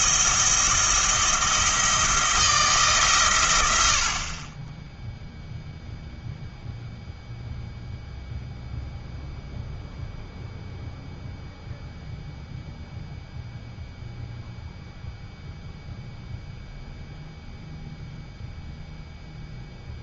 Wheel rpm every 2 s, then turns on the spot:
170, 150, 10, 0, 0, 0, 0, 0, 0, 0.
none